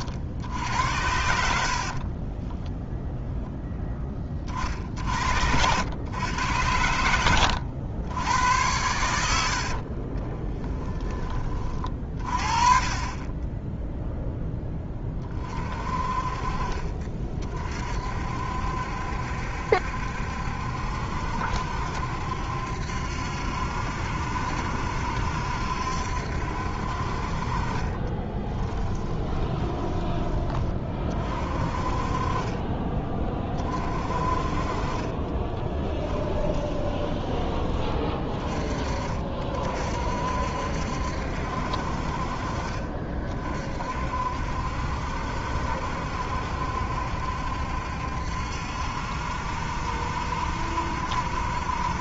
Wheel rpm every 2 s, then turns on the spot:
80, 0, 50, 90, 100, 10, 30, 10, 40, 60, 70, 70, 70, 60, 20, 30, 20, 40, 30, 30, 60, 40, 60, 70, 70, 70.
4-6 12-14 28-30 36-38